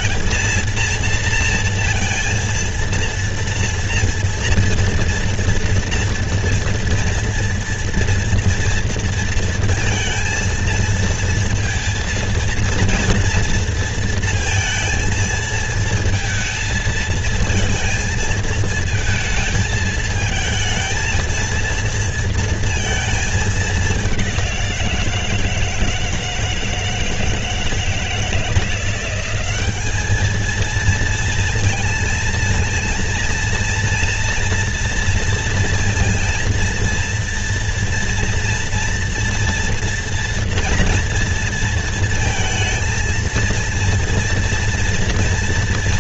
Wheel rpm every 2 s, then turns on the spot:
230, 230, 230, 230, 230, 230, 230, 230, 220, 220, 220, 230, 180, 160, 170, 220, 230, 230, 230, 230, 230, 230, 230.
none